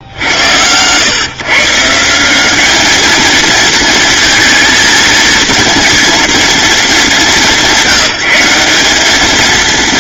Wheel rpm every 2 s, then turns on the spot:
100, 210, 230, 220, 190.
none